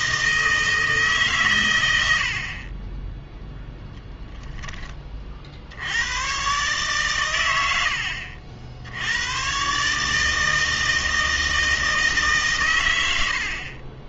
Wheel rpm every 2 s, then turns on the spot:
160, 30, 10, 130, 70, 160, 130.
none